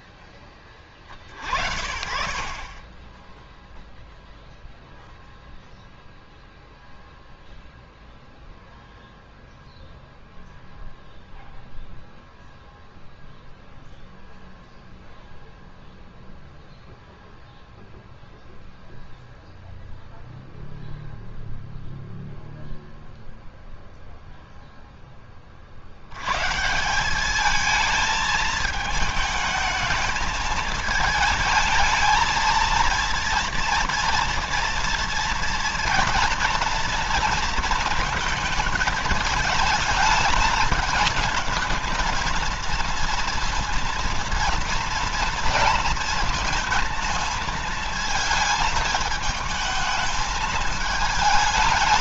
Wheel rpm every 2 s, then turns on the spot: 20, 50, 0, 0, 0, 0, 0, 0, 0, 0, 0, 0, 0, 140, 220, 220, 230, 230, 230, 220, 220, 230, 230, 230, 220, 220.
none